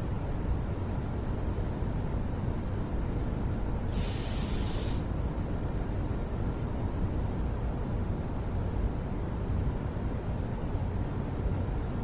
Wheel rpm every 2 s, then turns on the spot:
0, 0, 0, 0, 0, 0.
none